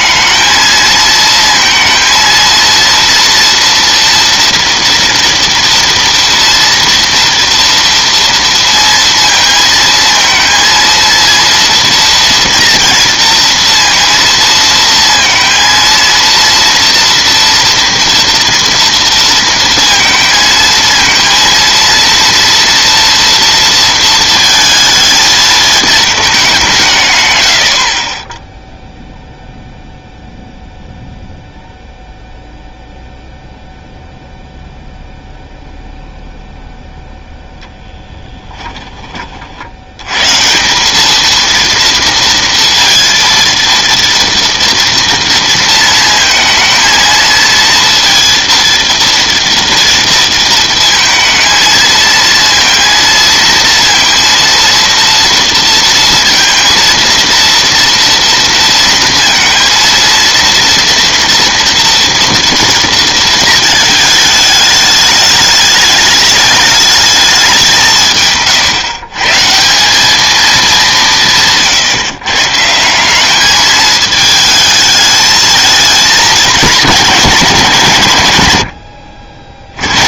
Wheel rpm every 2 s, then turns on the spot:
230, 240, 230, 230, 230, 230, 230, 230, 240, 230, 230, 230, 220, 60, 0, 0, 0, 0, 10, 90, 230, 230, 220, 230, 230, 230, 230, 230, 230, 230, 230, 220, 210, 160, 190, 140, 220, 220, 170, 60.
36-38